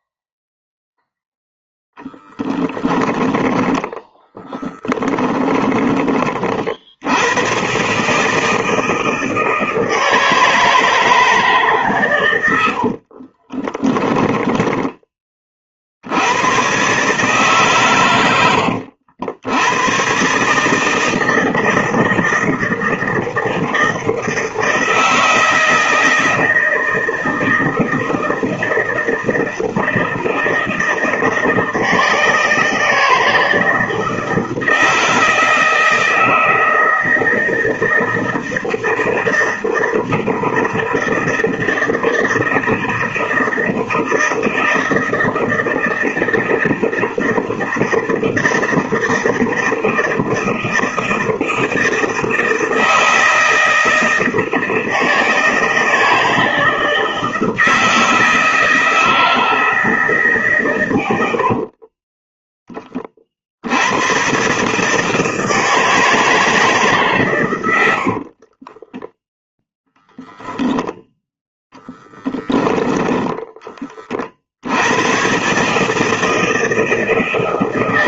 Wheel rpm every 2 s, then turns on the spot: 0, 10, 10, 90, 160, 160, 40, 20, 140, 80, 160, 160, 160, 160, 160, 160, 160, 160, 160, 160, 160, 160, 160, 160, 160, 160, 160, 160, 160, 160, 100, 30, 150, 150, 10, 0, 10, 100, 160.
2-6 12-14 68-70 72-74